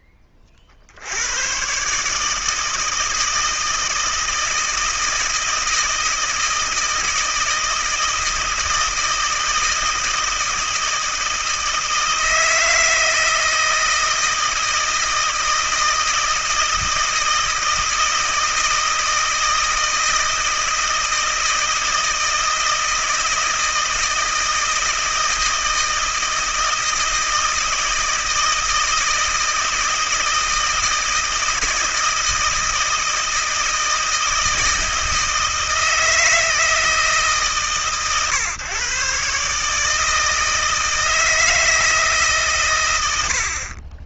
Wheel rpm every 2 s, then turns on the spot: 60, 160, 160, 160, 160, 160, 160, 160, 160, 160, 160, 160, 160, 160, 160, 160, 160, 160, 160, 140, 160, 120.
none